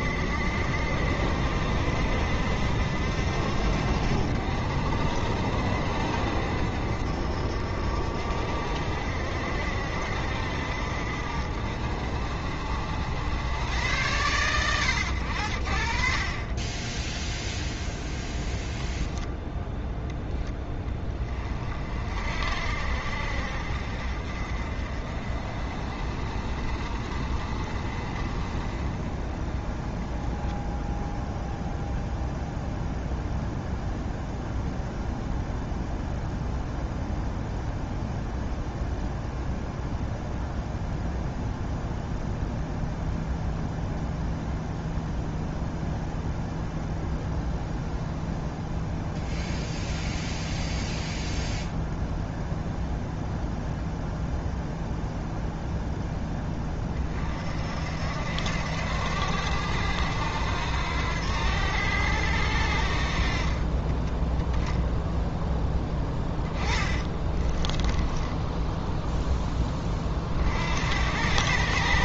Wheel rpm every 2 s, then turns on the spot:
60, 60, 70, 60, 60, 60, 70, 100, 20, 0, 10, 50, 40, 40, 30, 0, 0, 0, 0, 0, 0, 0, 0, 0, 0, 0, 0, 0, 20, 80, 90, 70, 0, 20, 10, 60.
66-70